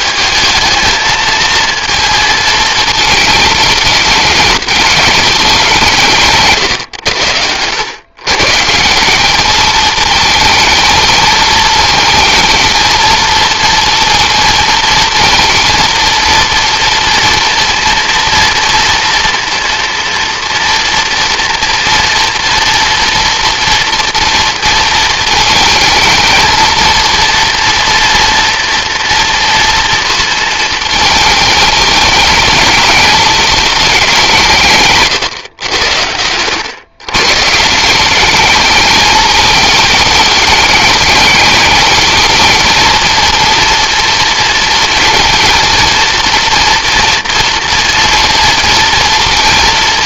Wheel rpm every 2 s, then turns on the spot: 220, 230, 210, 120, 140, 220, 220, 220, 230, 230, 230, 230, 230, 230, 230, 220, 220, 160, 110, 210, 210, 220, 230, 230, 230.
none